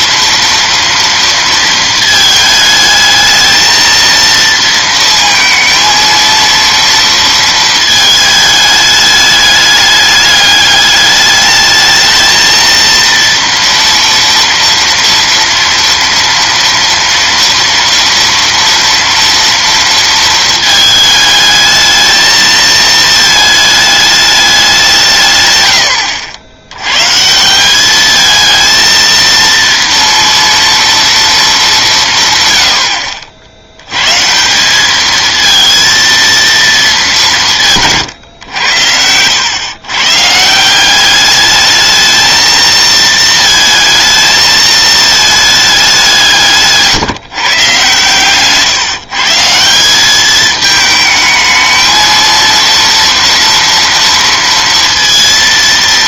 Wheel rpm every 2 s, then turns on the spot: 230, 220, 230, 230, 210, 210, 230, 230, 230, 240, 220, 220, 200, 90, 220, 230, 120, 180, 230, 100, 160, 220, 220, 150, 140, 210, 230, 230.
none